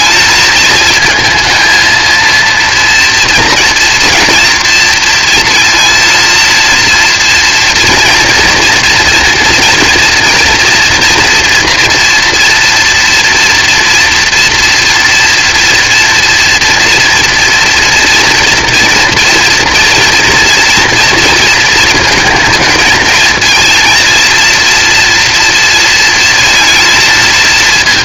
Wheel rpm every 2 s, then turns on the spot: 220, 230, 230, 230, 230, 230, 240, 230, 240, 230, 230, 230, 230, 230.
none